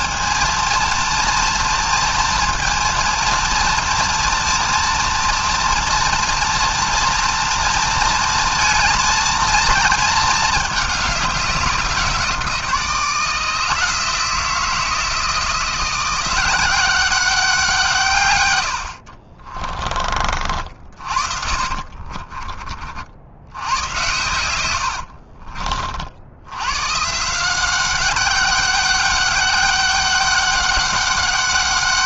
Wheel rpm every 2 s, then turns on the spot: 230, 230, 230, 230, 230, 220, 170, 160, 180, 110, 50, 40, 100, 90, 190, 200.
none